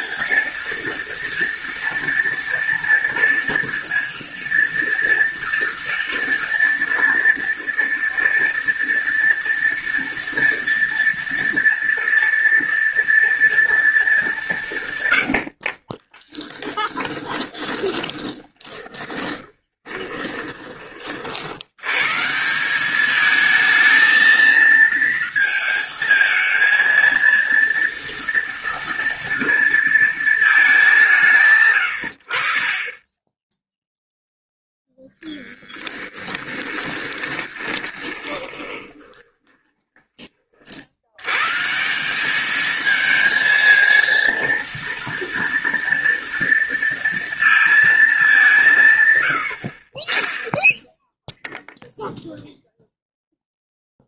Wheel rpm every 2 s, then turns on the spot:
230, 230, 230, 230, 230, 230, 230, 120, 20, 30, 30, 200, 230, 230, 230, 180, 20, 0, 20, 20, 80, 220, 230, 230, 140, 0, 0.
14-20 36-40